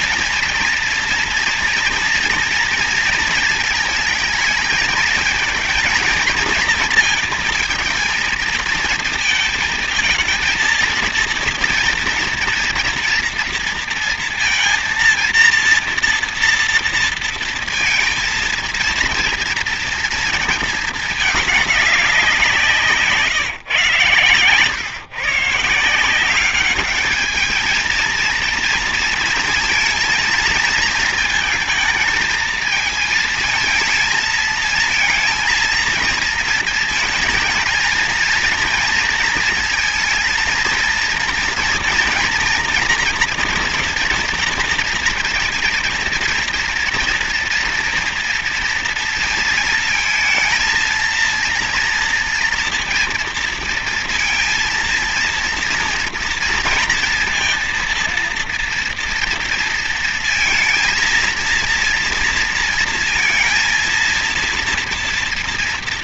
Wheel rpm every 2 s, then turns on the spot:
230, 230, 220, 230, 230, 230, 230, 230, 230, 230, 220, 170, 120, 200, 220, 230, 220, 220, 230, 230, 230, 230, 240, 240, 230, 230, 230, 230, 230, 230, 230, 230, 230.
none